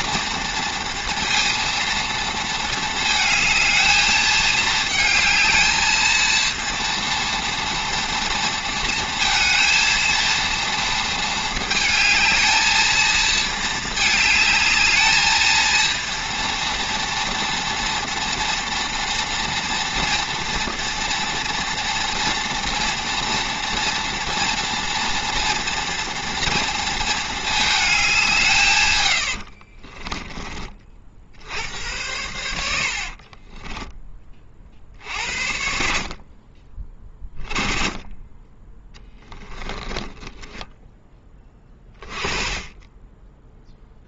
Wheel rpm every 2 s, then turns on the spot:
230, 220, 220, 230, 230, 230, 220, 220, 230, 230, 230, 230, 240, 230, 130, 40, 80, 50, 20, 10, 10, 10.
32-34 38-40